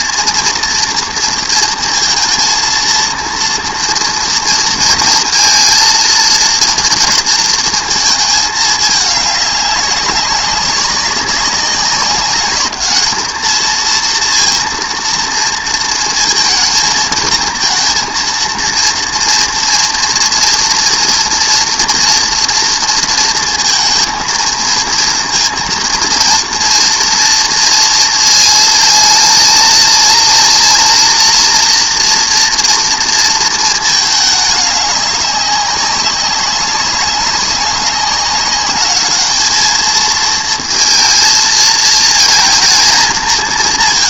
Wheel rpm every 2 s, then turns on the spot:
230, 230, 230, 230, 210, 200, 210, 230, 220, 230, 230, 240, 230, 230, 230, 230, 230, 210, 200, 200, 220, 220.
none